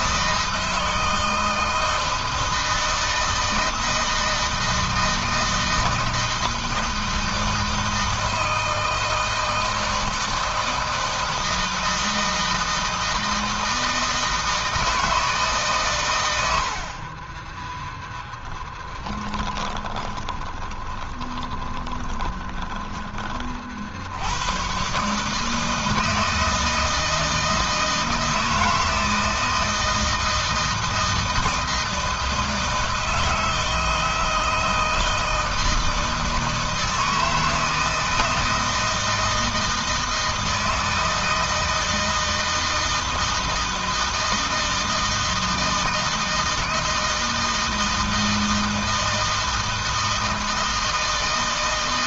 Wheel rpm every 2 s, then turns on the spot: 160, 160, 160, 160, 160, 160, 160, 160, 90, 10, 20, 20, 110, 160, 160, 160, 160, 160, 160, 160, 160, 160, 160, 160, 160, 160.
18-24